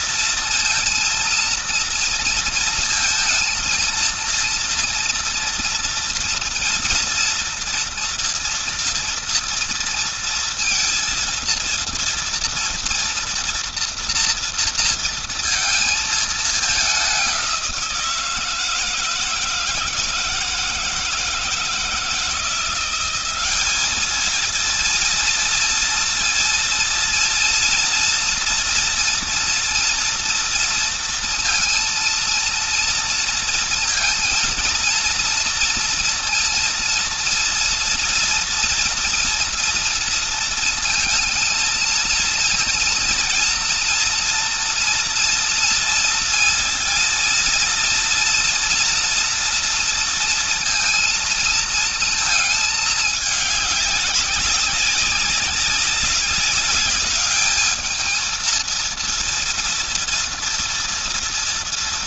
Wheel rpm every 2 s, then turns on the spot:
230, 230, 230, 230, 230, 230, 230, 230, 200, 160, 160, 180, 230, 230, 230, 230, 230, 230, 230, 230, 230, 230, 230, 230, 230, 230, 210, 190, 200, 230, 230.
none